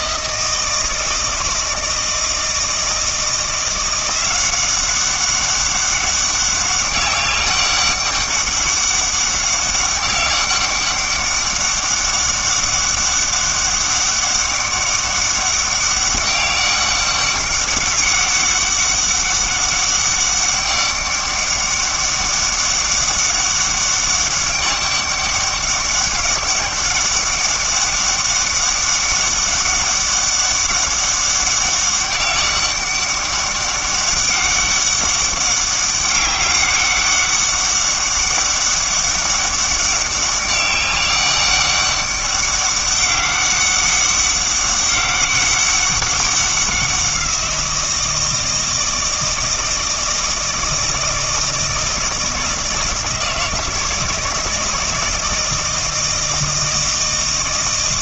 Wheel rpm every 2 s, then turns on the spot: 160, 160, 190, 200, 200, 200, 200, 200, 200, 200, 200, 200, 200, 200, 200, 200, 200, 200, 200, 200, 200, 200, 200, 190, 160, 160, 160, 160, 160.
none